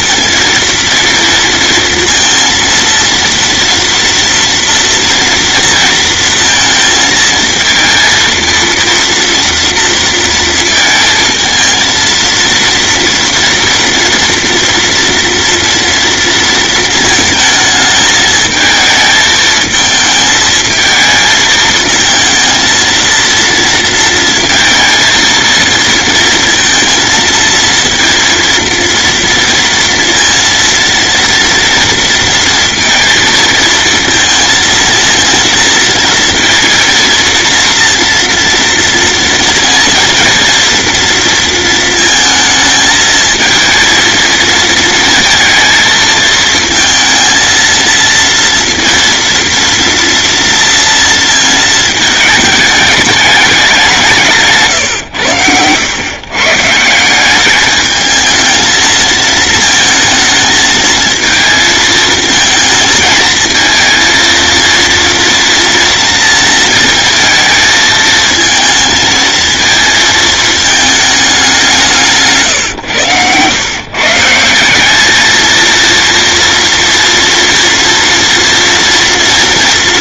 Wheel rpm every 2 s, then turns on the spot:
230, 230, 230, 230, 230, 220, 230, 240, 220, 220, 220, 230, 230, 230, 230, 230, 230, 230, 230, 230, 230, 220, 230, 230, 230, 230, 210, 110, 170, 220, 220, 220, 230, 230, 230, 220, 110, 200, 230, 230.
none